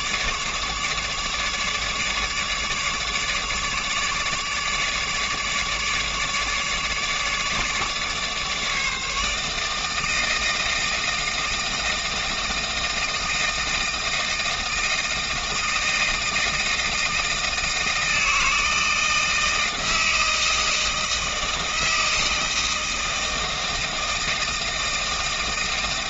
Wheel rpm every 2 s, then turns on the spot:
150, 150, 150, 150, 150, 160, 160, 160, 160, 160, 160, 160, 160.
none